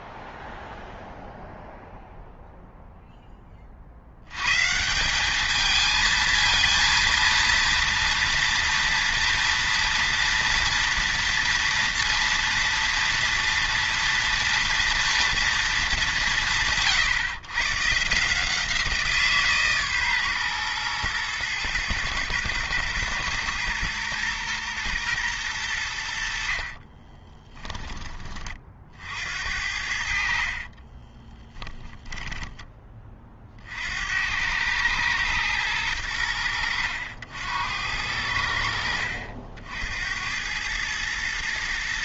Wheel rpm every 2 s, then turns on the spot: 0, 0, 160, 230, 240, 230, 230, 240, 150, 170, 120, 120, 120, 40, 50, 30, 20, 110, 90, 70, 110.
26-28 30-32